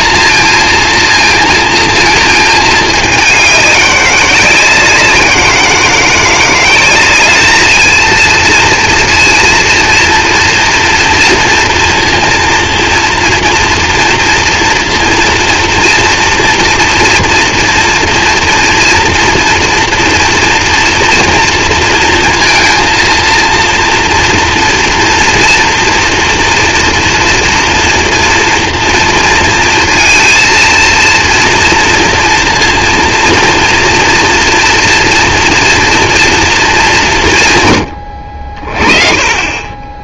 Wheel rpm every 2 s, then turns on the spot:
230, 220, 180, 180, 230, 230, 230, 230, 230, 230, 230, 230, 230, 230, 230, 230, 230, 230, 220, 40.
none